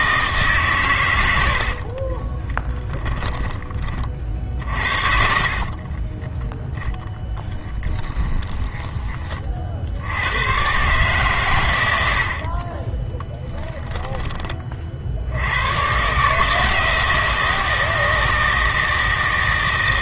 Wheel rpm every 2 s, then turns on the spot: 130, 10, 50, 0, 10, 130, 30, 40, 160, 160.
2-6 8-10 12-14